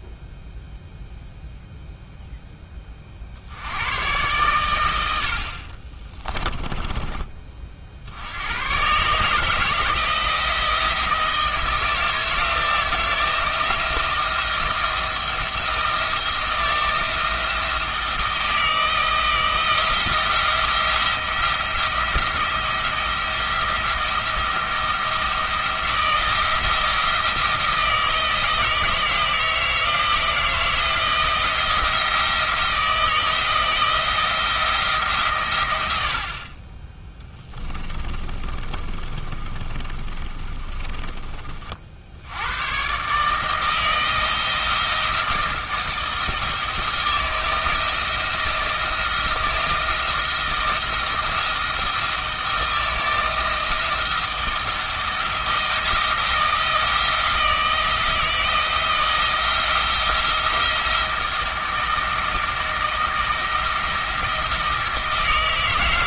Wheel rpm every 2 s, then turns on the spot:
0, 10, 100, 20, 120, 160, 160, 160, 170, 170, 170, 170, 170, 170, 160, 170, 170, 160, 20, 40, 30, 120, 170, 160, 170, 170, 170, 170, 170, 170, 170, 160, 160.
38-42